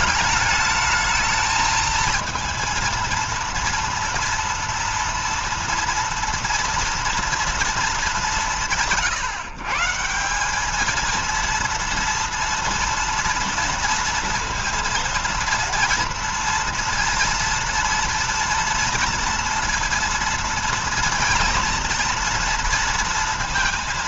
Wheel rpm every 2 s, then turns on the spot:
220, 230, 230, 230, 180, 200, 230, 230, 240, 230, 230, 230.
none